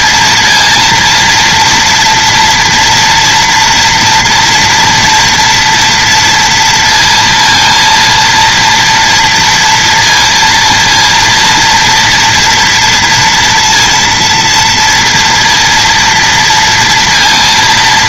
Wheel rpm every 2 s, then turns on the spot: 230, 230, 240, 230, 230, 230, 230, 230, 230.
none